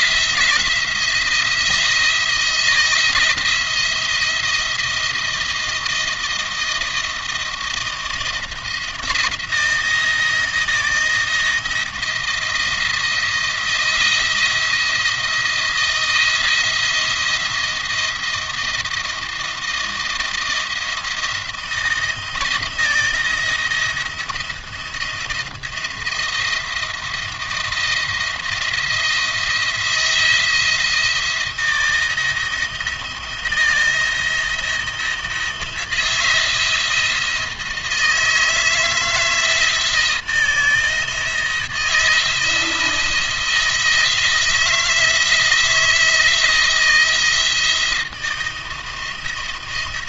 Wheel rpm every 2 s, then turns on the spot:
170, 160, 170, 160, 170, 160, 170, 170, 170, 160, 170, 160, 170, 170, 170, 170, 170, 170, 170, 160, 160, 160, 160, 160, 170.
none